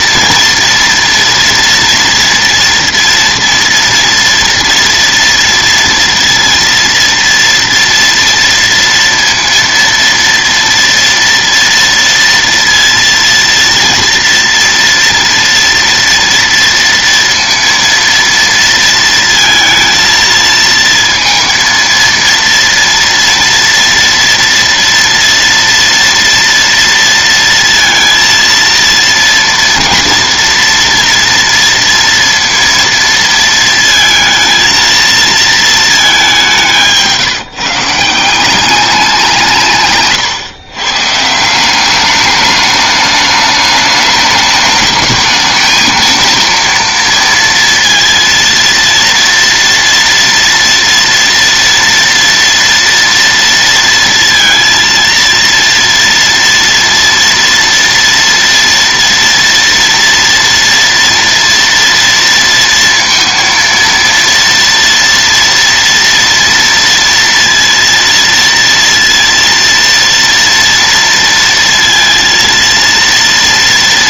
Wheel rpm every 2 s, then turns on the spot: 230, 230, 230, 230, 230, 230, 230, 230, 230, 230, 230, 230, 230, 230, 230, 230, 230, 230, 170, 190, 140, 210, 210, 230, 230, 230, 240, 230, 230, 230, 230, 230, 230, 230, 230, 230, 230.
none